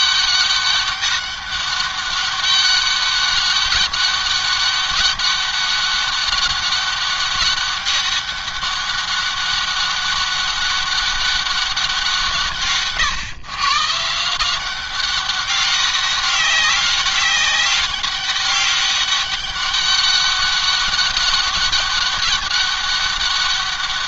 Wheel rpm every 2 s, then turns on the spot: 200, 200, 200, 200, 200, 200, 150, 180, 200, 190, 200, 200.
none